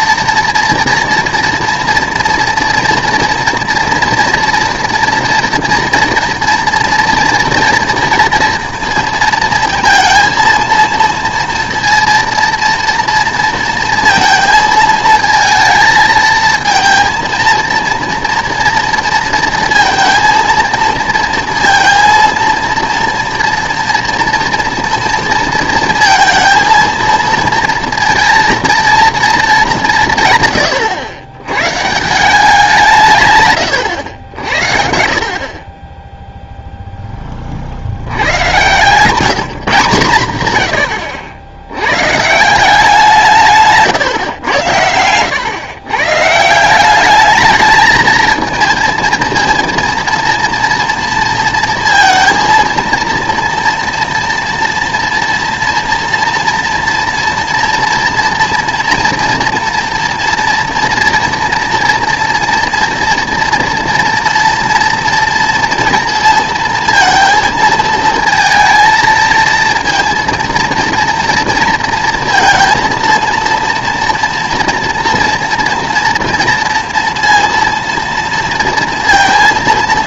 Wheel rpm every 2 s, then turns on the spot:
230, 230, 230, 230, 230, 230, 230, 220, 220, 230, 230, 230, 230, 230, 230, 120, 180, 70, 0, 110, 110, 170, 100, 170, 220, 230, 230, 230, 230, 240, 230, 230, 230, 230, 230, 230, 230, 230, 230, 230.
none